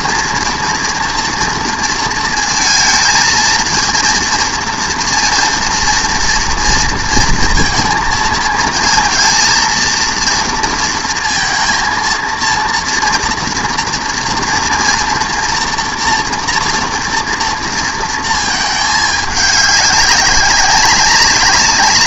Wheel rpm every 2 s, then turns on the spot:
230, 230, 230, 230, 220, 230, 230, 230, 230, 220, 190.
none